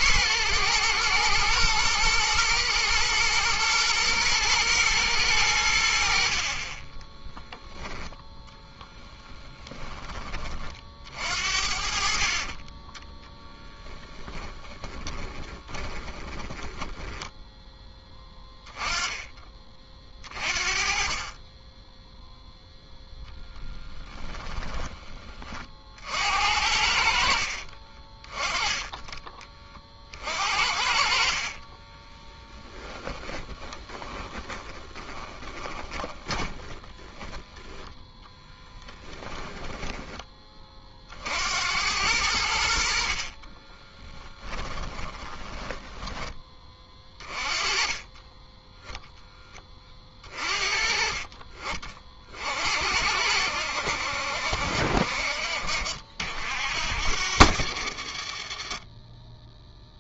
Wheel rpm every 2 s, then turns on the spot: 110, 110, 110, 20, 0, 50, 20, 10, 10, 10, 40, 0, 10, 60, 20, 50, 10, 20, 10, 10, 30, 60, 20, 20, 10, 40, 70, 60, 70, 20.
14-18 30-40 44-46